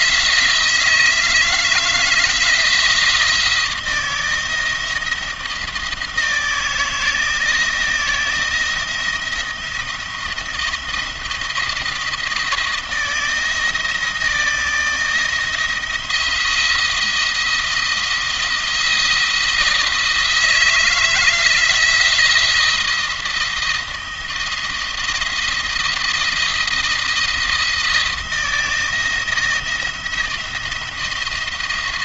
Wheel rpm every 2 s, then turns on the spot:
170, 170, 170, 160, 170, 170, 170, 160, 170, 170, 160, 170, 170, 170, 170, 170.
none